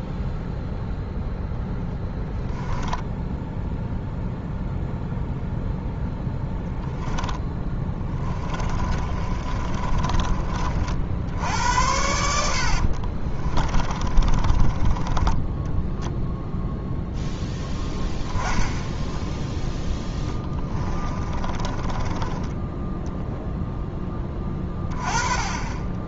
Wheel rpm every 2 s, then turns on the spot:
0, 0, 0, 10, 30, 40, 60, 30, 0, 10, 20, 10, 30.
8-10 12-16 20-24